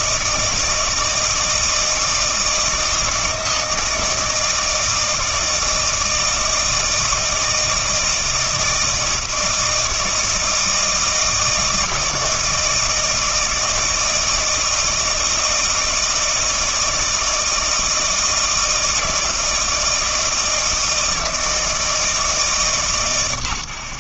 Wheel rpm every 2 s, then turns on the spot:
160, 160, 160, 160, 160, 160, 160, 160, 160, 160, 160, 150.
none